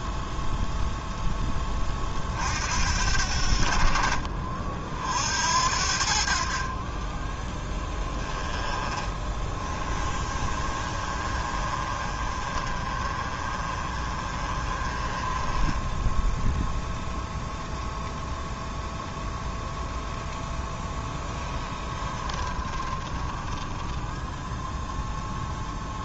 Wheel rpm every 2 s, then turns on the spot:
0, 60, 50, 40, 20, 30, 30, 30, 0, 0, 0, 20, 0.
8-16 22-24